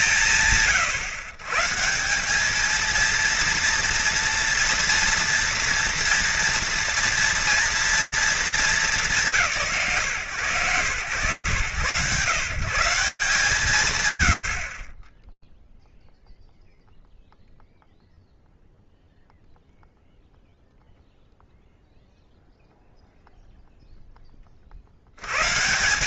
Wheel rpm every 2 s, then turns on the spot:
140, 230, 230, 230, 170, 130, 150, 0, 0, 0, 0, 0, 100.
none